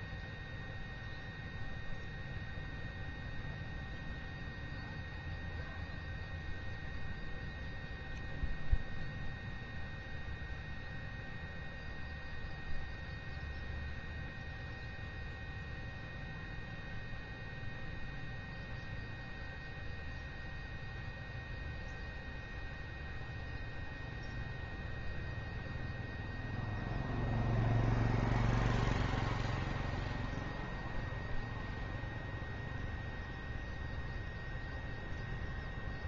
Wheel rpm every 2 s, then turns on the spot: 0, 0, 0, 0, 0, 0, 0, 0, 0, 0, 0, 0, 0, 0, 0, 0, 0, 0.
none